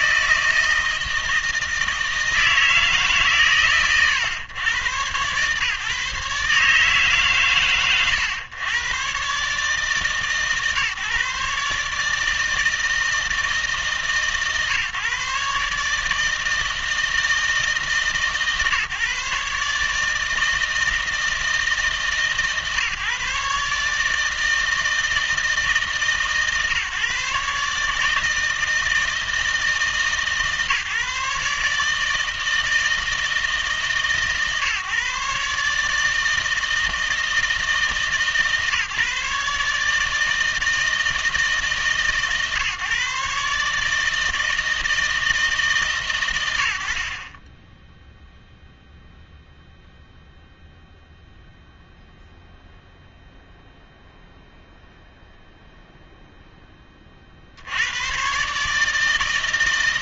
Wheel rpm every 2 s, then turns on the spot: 160, 160, 110, 150, 120, 150, 160, 150, 160, 150, 160, 150, 160, 140, 160, 140, 160, 140, 160, 150, 160, 140, 160, 70, 0, 0, 0, 0, 20, 150.
none